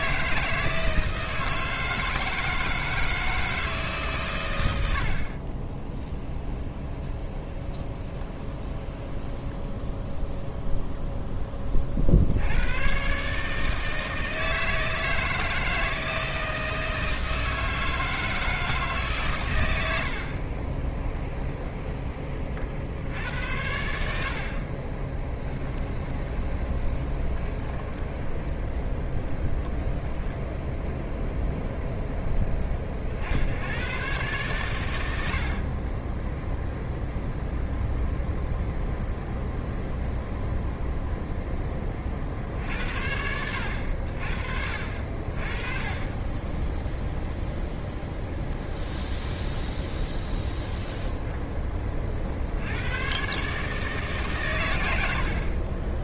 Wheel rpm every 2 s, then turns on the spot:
160, 160, 80, 20, 10, 0, 120, 160, 160, 150, 20, 60, 30, 20, 10, 0, 40, 120, 0, 0, 0, 70, 60, 0, 0, 10, 90, 90.
6-10 24-28 50-52